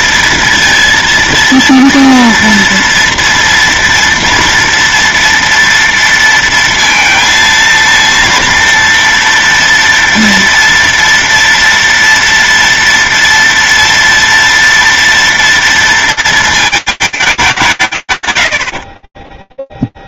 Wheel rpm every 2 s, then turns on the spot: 230, 230, 230, 230, 230, 230, 230, 230, 210, 20.
18-20